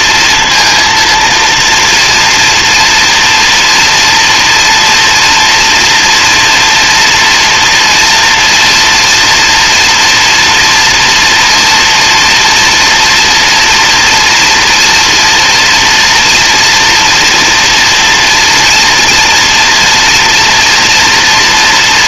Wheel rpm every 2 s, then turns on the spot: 230, 230, 240, 230, 230, 240, 230, 240, 240, 230, 240.
none